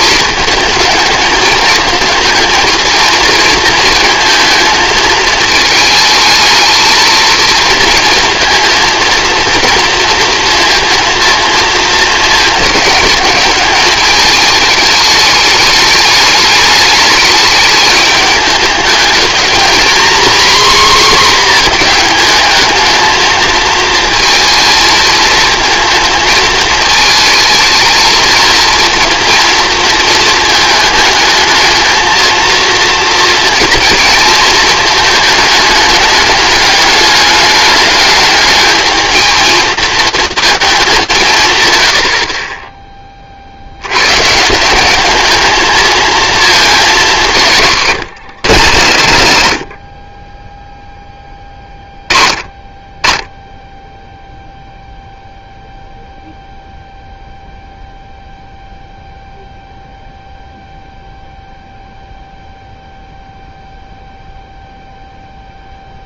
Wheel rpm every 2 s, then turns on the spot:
220, 230, 230, 220, 230, 230, 220, 210, 210, 210, 250, 220, 230, 220, 230, 220, 220, 220, 210, 220, 220, 10, 160, 220, 140, 10, 20, 0, 0, 0, 0, 0, 0.
none